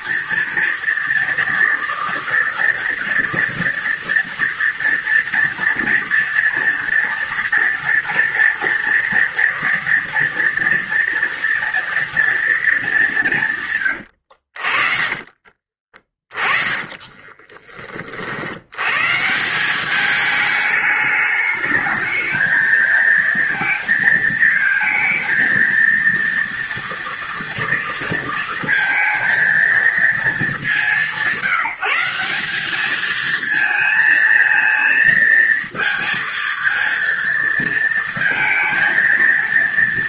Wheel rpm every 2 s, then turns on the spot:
230, 230, 230, 230, 230, 230, 180, 30, 20, 150, 210, 220, 230, 230, 230, 160, 220, 230, 230, 230.
14-18